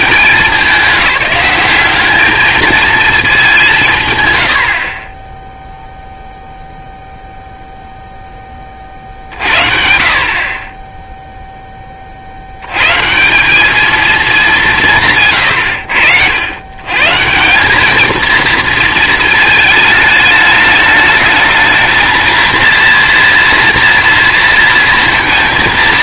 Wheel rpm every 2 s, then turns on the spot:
190, 220, 30, 0, 50, 10, 150, 140, 150, 220, 210, 230, 230.
none